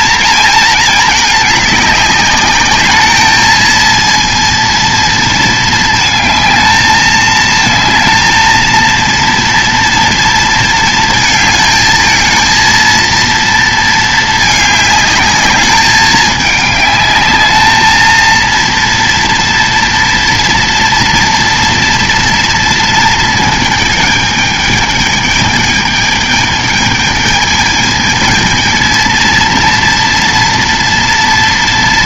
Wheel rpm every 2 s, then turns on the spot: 220, 210, 230, 220, 230, 230, 220, 210, 210, 230, 230, 230, 220, 210, 220, 230.
none